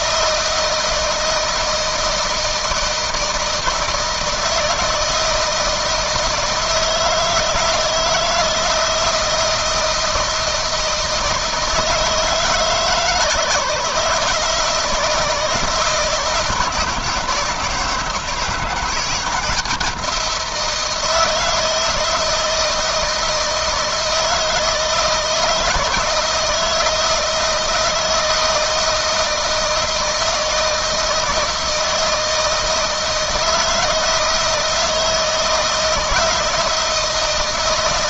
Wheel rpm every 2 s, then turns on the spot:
160, 160, 160, 160, 160, 160, 160, 160, 170, 170, 170, 160, 160, 160, 160, 160, 160, 160, 160.
none